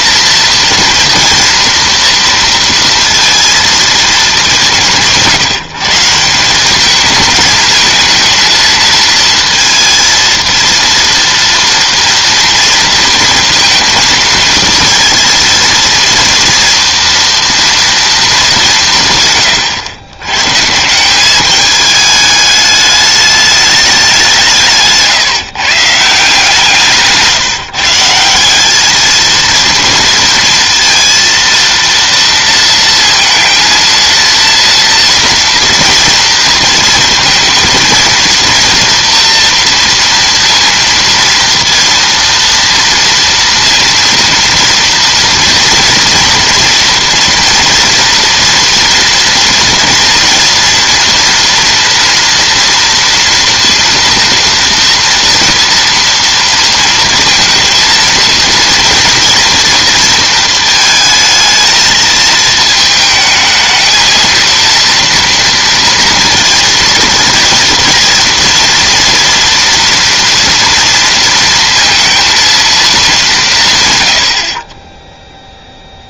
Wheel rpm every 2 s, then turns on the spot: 240, 230, 160, 190, 230, 230, 230, 230, 230, 180, 150, 210, 160, 160, 190, 230, 230, 230, 230, 240, 230, 230, 230, 230, 240, 230, 240, 230, 230, 230, 220, 220, 230, 230, 230, 230, 230, 40.
none